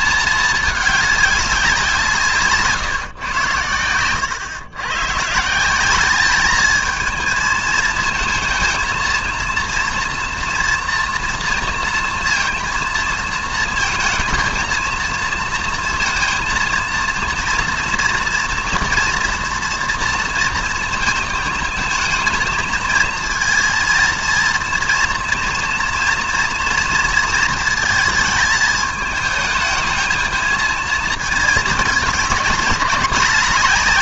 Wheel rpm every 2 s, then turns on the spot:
210, 160, 130, 220, 230, 230, 230, 220, 230, 230, 230, 230, 230, 230, 220, 230, 200.
none